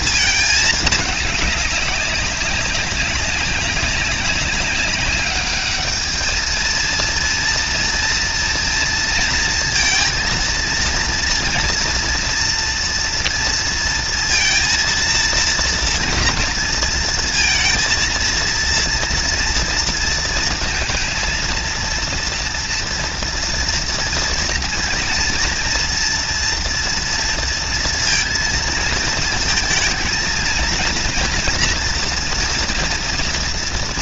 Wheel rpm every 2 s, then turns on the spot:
210, 200, 200, 230, 230, 230, 230, 230, 230, 230, 230, 240, 230, 230, 230, 230, 230.
none